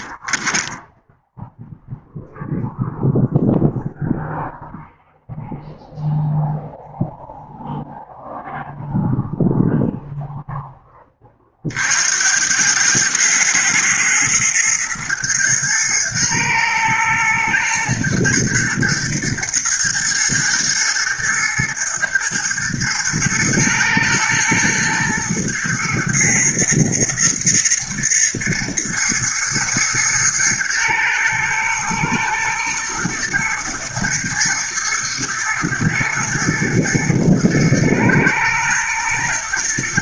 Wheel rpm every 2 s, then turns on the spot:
0, 0, 0, 0, 0, 20, 110, 120, 120, 120, 120, 110, 120, 110, 120, 110, 120, 120, 120, 110.
none